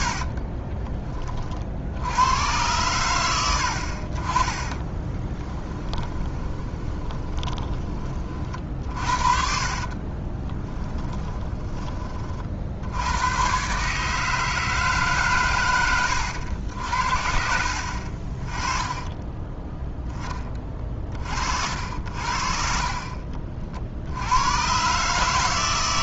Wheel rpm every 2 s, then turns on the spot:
40, 100, 30, 20, 50, 30, 50, 150, 80, 30, 20, 60, 110.
0-2 4-8 10-12